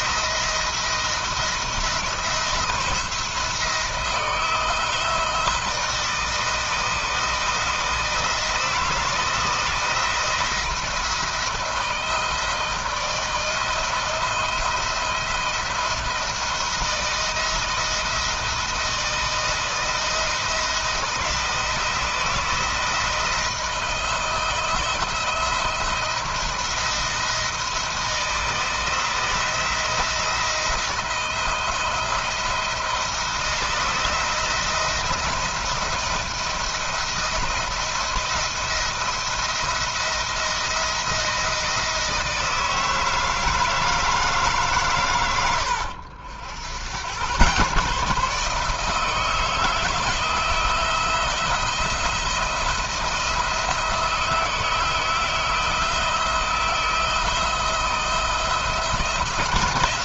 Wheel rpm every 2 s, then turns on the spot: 170, 170, 160, 160, 160, 170, 160, 170, 170, 170, 170, 160, 170, 160, 170, 170, 160, 170, 170, 170, 170, 160, 120, 100, 160, 170, 170, 160, 160, 170.
none